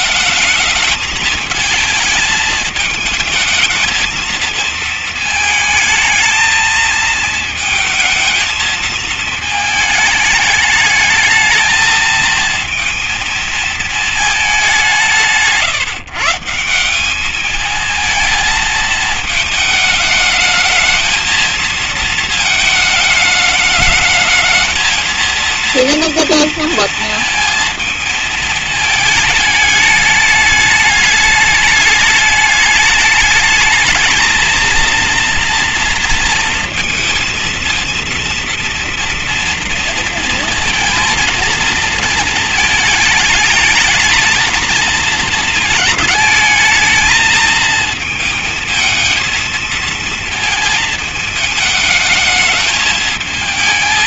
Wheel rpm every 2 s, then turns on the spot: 220, 220, 220, 220, 220, 210, 230, 180, 190, 220, 220, 220, 220, 230, 220, 210, 210, 230, 230, 230, 230, 220, 220, 220, 220, 220, 210.
none